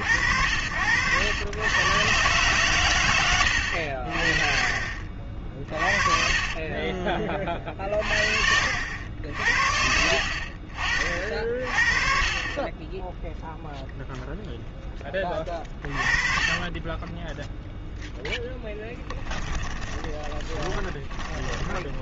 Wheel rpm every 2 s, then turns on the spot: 90, 110, 50, 30, 70, 50, 20, 10, 10, 10, 20.
8-10 16-22